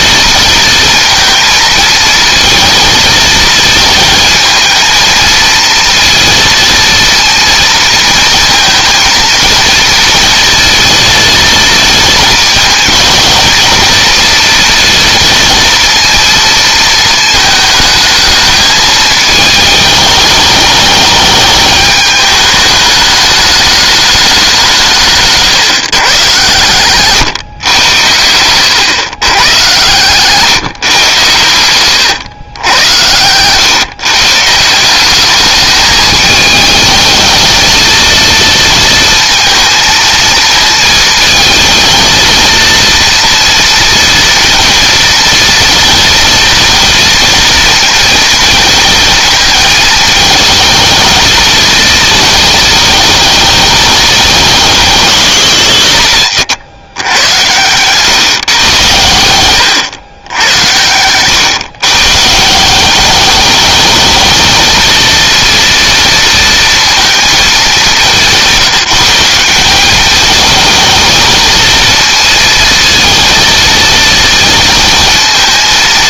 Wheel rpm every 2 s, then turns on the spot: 230, 220, 220, 230, 230, 230, 220, 230, 220, 220, 210, 210, 150, 120, 120, 130, 90, 180, 220, 230, 230, 230, 230, 230, 220, 220, 220, 190, 110, 120, 110, 190, 220, 230, 180, 220, 230, 230.
60-62